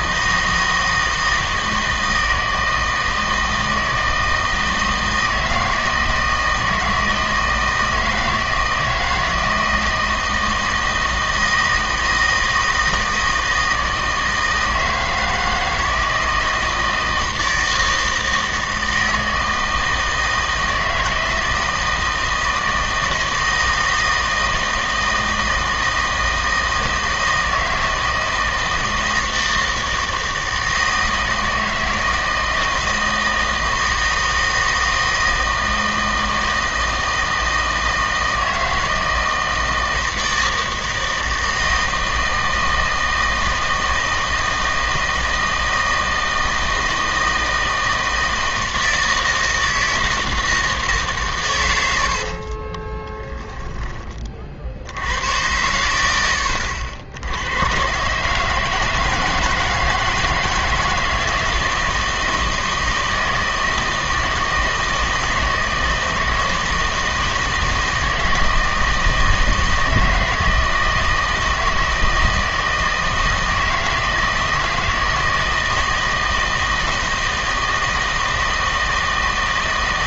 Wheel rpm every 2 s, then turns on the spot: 160, 160, 160, 160, 160, 160, 160, 160, 160, 160, 160, 160, 160, 160, 160, 160, 160, 160, 160, 160, 160, 160, 160, 160, 160, 160, 40, 50, 80, 160, 160, 160, 160, 160, 160, 160, 160, 160, 160, 160.
52-54